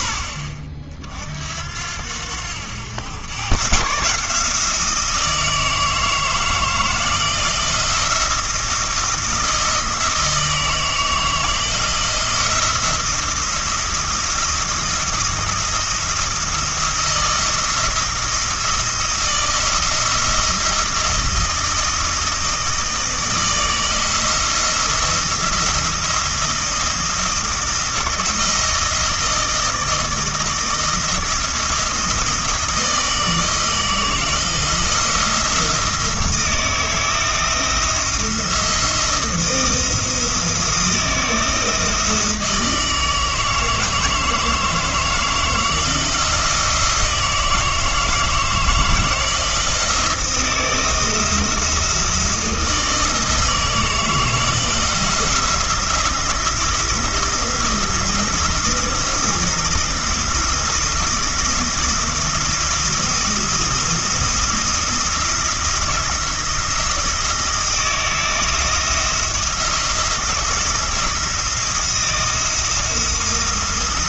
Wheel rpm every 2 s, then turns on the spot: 40, 90, 160, 160, 170, 160, 170, 170, 170, 170, 170, 160, 170, 160, 160, 170, 160, 170, 170, 170, 160, 160, 160, 170, 160, 170, 160, 160, 170, 160, 170, 170, 170, 170, 170, 170, 170.
none